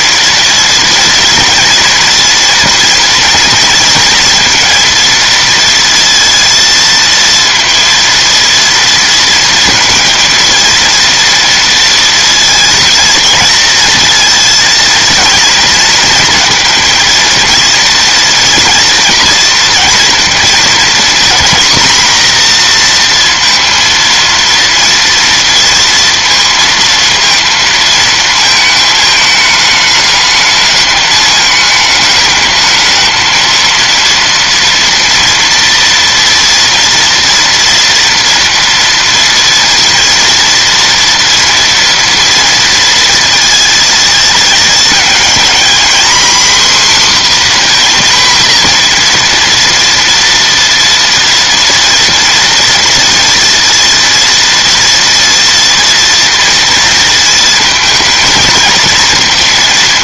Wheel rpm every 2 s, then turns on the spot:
240, 230, 230, 230, 230, 230, 230, 230, 230, 230, 230, 230, 230, 230, 220, 220, 220, 230, 240, 230, 230, 230, 220, 260, 240, 230, 240, 230, 230, 230.
none